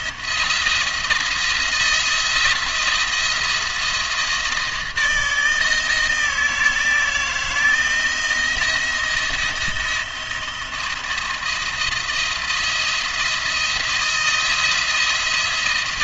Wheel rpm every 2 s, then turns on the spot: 170, 170, 160, 160, 170, 170, 170, 170.
none